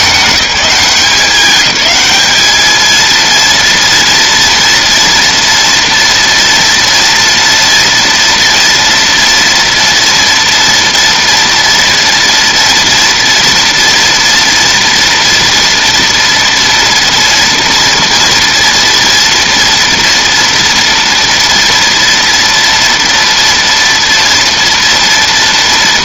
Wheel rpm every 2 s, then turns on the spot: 200, 220, 230, 230, 240, 230, 230, 230, 230, 230, 230, 230, 230.
none